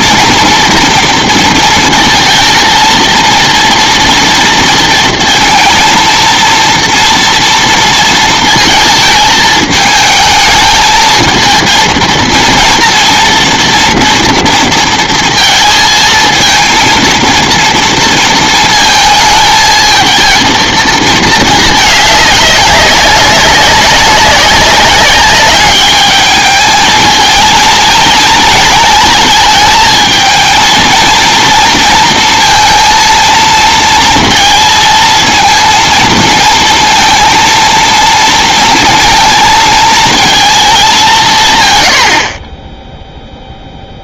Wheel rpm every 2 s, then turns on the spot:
230, 230, 230, 230, 230, 220, 230, 230, 230, 230, 230, 200, 200, 220, 220, 230, 230, 230, 230, 230, 210, 10.
none